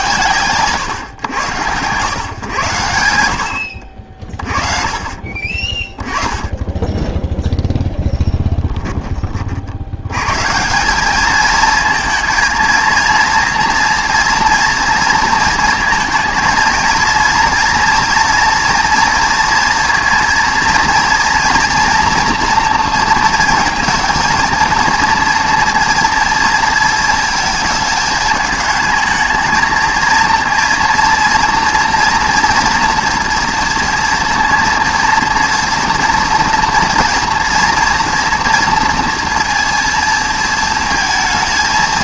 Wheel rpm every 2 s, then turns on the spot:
120, 100, 40, 10, 10, 170, 230, 230, 230, 230, 230, 230, 230, 230, 220, 230, 230, 230, 230, 230, 220.
none